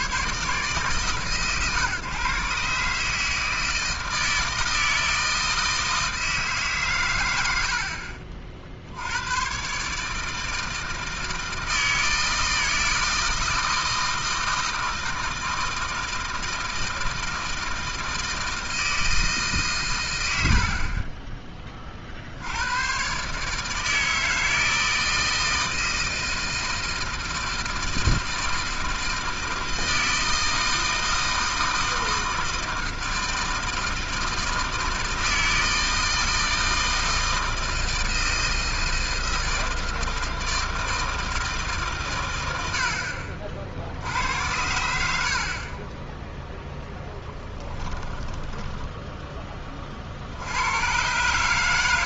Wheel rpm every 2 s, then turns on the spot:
140, 140, 160, 150, 40, 160, 160, 160, 160, 160, 70, 80, 160, 160, 160, 160, 160, 160, 160, 160, 160, 90, 90, 0, 10, 100.
20-22 48-50